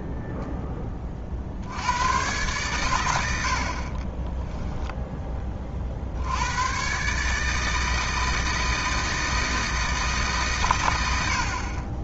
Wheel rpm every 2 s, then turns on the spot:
10, 110, 0, 110, 160, 110.
none